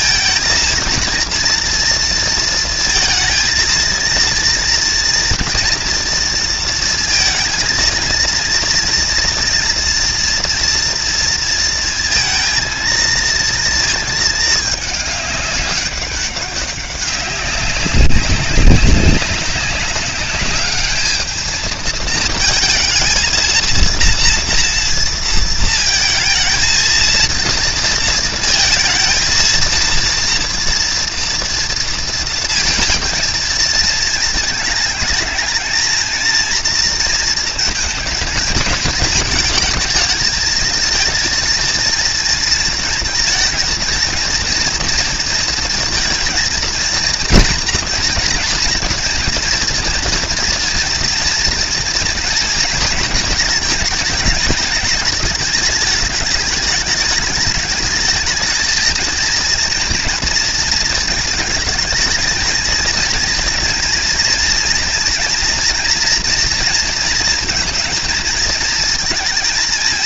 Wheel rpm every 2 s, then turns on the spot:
230, 230, 240, 230, 230, 230, 230, 210, 200, 190, 210, 230, 230, 230, 230, 230, 220, 220, 230, 220, 220, 230, 230, 230, 230, 230, 230, 210, 210, 230, 230, 230, 230, 230, 230.
none